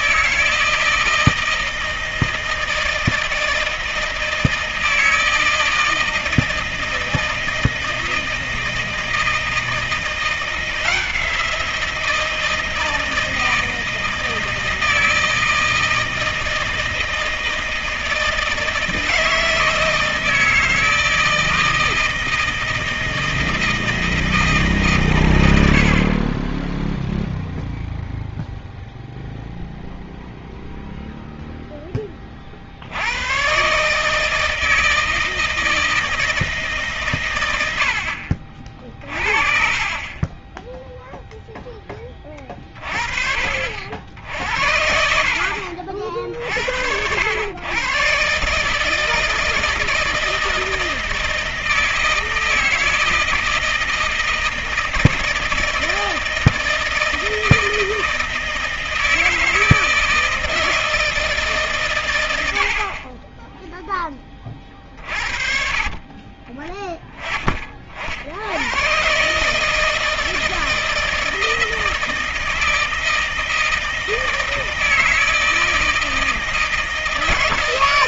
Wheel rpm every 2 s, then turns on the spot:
160, 160, 160, 160, 160, 170, 170, 160, 160, 160, 160, 160, 160, 20, 0, 0, 40, 160, 150, 50, 10, 20, 70, 60, 140, 160, 160, 160, 160, 160, 160, 90, 30, 30, 70, 160, 160, 160, 160.
none